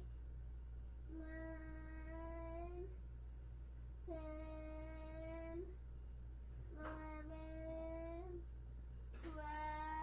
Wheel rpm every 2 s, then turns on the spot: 0, 0, 0, 0, 0.
none